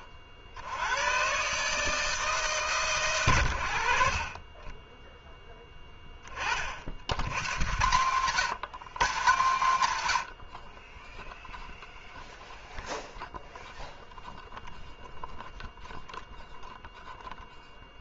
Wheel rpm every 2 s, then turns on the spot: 90, 150, 30, 50, 160, 30, 0, 0, 0.
none